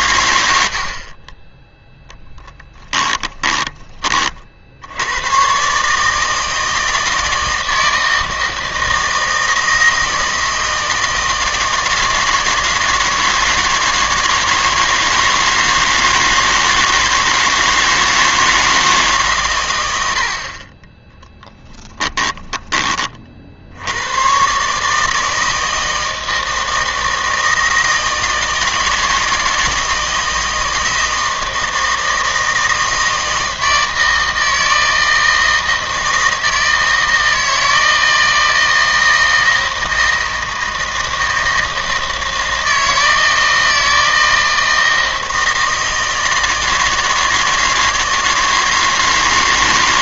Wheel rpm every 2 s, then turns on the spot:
70, 20, 60, 160, 160, 160, 160, 160, 160, 160, 40, 20, 140, 160, 160, 160, 160, 160, 160, 160, 160, 160, 160, 160, 160.
2-4